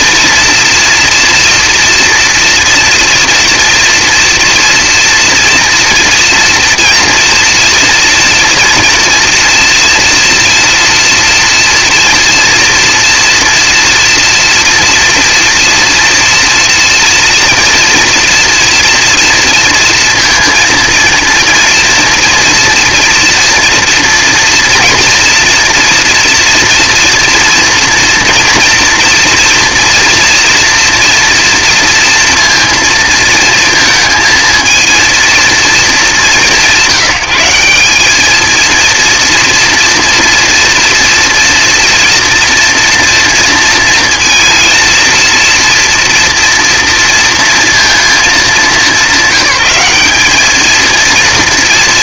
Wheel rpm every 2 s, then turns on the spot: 230, 230, 230, 230, 230, 240, 240, 240, 230, 230, 230, 230, 230, 230, 240, 230, 230, 230, 180, 230, 230, 230, 230, 240, 190, 220.
none